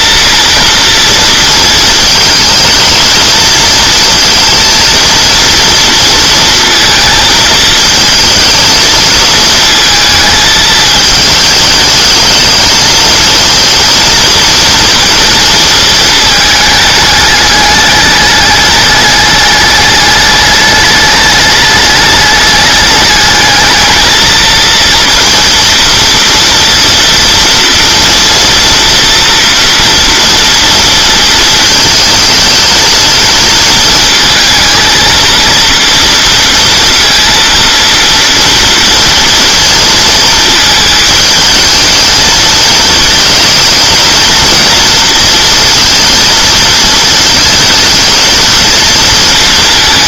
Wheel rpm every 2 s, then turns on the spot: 230, 220, 230, 230, 220, 220, 220, 230, 210, 210, 210, 210, 230, 230, 230, 230, 220, 230, 230, 230, 220, 220, 230, 220, 230.
none